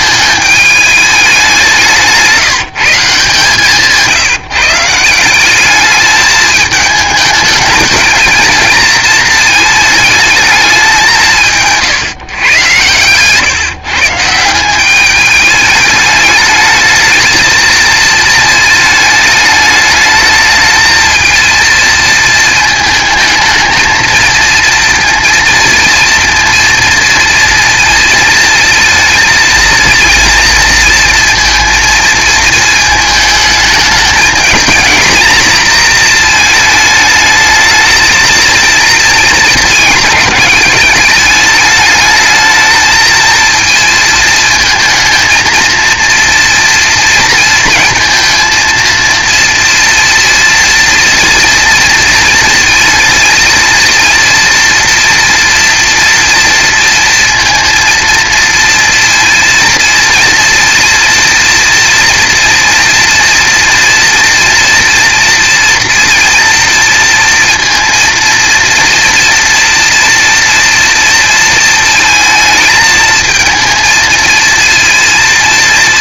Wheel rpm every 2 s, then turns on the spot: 210, 160, 160, 220, 230, 200, 120, 190, 220, 220, 220, 220, 230, 230, 230, 230, 220, 220, 220, 230, 210, 220, 220, 230, 230, 240, 230, 230, 230, 230, 230, 230, 230, 230, 230, 230, 220, 230.
none